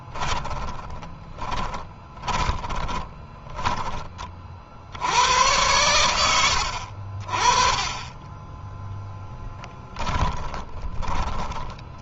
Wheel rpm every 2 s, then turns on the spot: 20, 20, 70, 50, 10, 10.
0-4 8-12